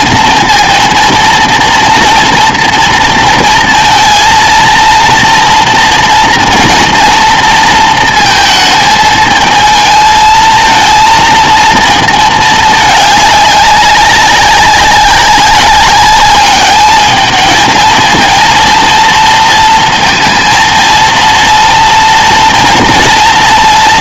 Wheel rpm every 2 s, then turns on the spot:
230, 230, 230, 230, 220, 230, 210, 190, 210, 230, 230, 230.
none